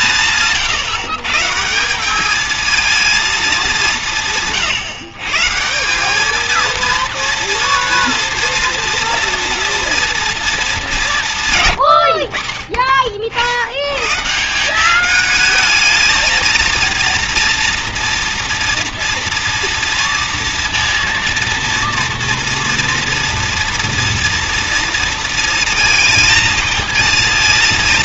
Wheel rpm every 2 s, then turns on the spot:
120, 220, 150, 230, 230, 210, 30, 190, 230, 230, 230, 230, 230, 220.
none